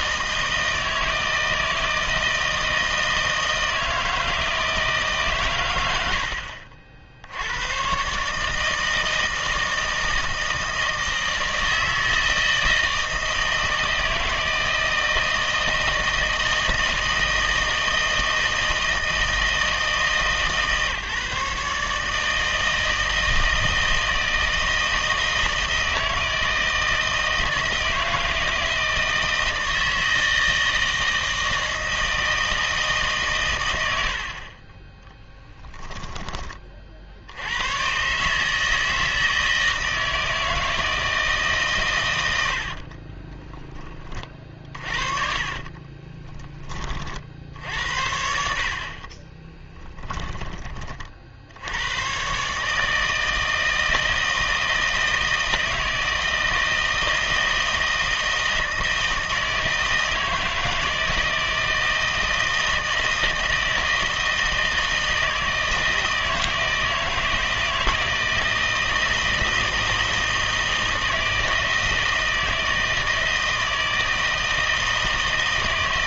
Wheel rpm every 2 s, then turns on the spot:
160, 160, 160, 60, 160, 160, 160, 160, 160, 160, 150, 160, 160, 160, 160, 160, 160, 30, 30, 150, 160, 70, 30, 20, 50, 30, 140, 160, 160, 160, 160, 160, 160, 160, 160, 160, 160, 160.
42-46